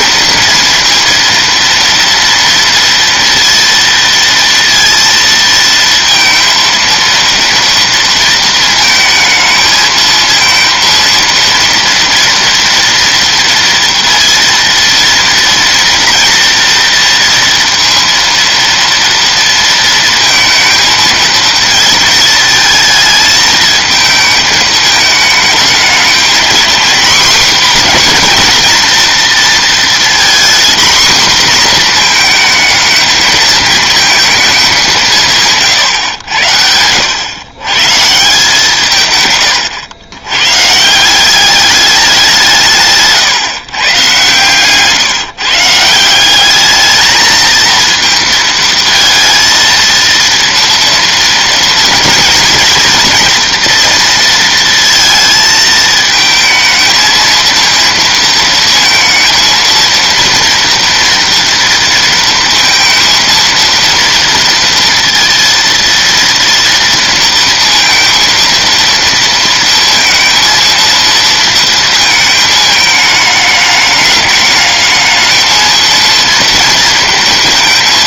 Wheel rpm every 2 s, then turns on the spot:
230, 230, 230, 230, 220, 230, 230, 230, 230, 230, 220, 220, 220, 240, 240, 240, 220, 190, 80, 170, 130, 170, 140, 210, 230, 230, 230, 230, 220, 230, 240, 230, 230, 230, 230, 230, 220, 210, 230.
42-44